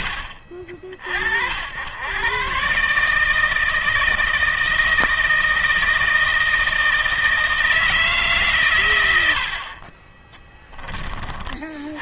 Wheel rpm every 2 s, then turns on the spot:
60, 140, 160, 160, 120, 20.
none